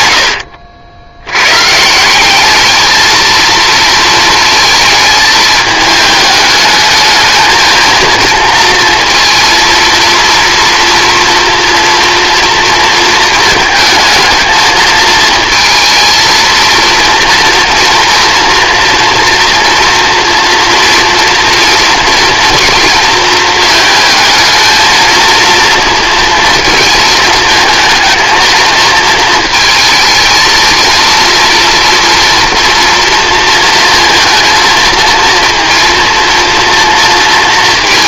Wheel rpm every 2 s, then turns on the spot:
80, 220, 220, 210, 230, 240, 230, 220, 230, 230, 240, 230, 220, 230, 220, 230, 230, 230, 230.
none